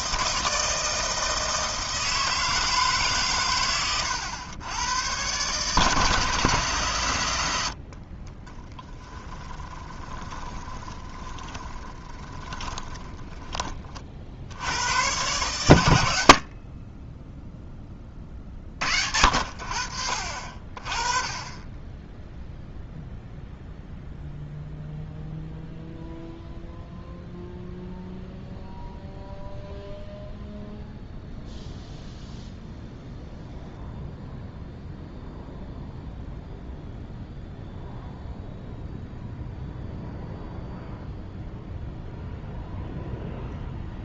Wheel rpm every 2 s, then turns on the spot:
160, 150, 100, 130, 20, 30, 10, 100, 60, 60, 30, 0, 0, 0, 0, 0, 0, 0, 0, 0, 0, 0.
8-14